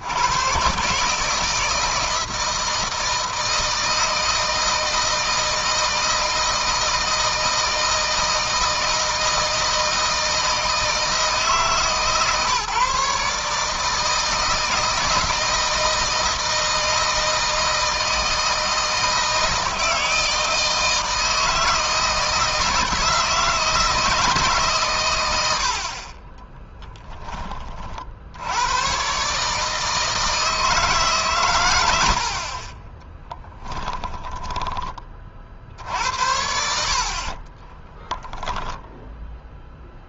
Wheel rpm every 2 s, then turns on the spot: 130, 160, 160, 160, 160, 160, 140, 160, 160, 160, 160, 170, 130, 10, 120, 150, 30, 20, 50, 0.
32-34